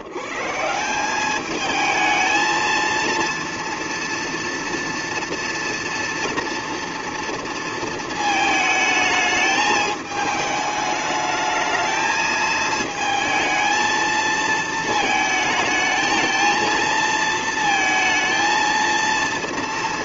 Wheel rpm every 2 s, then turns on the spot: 150, 230, 230, 230, 220, 210, 220, 220, 220, 230.
none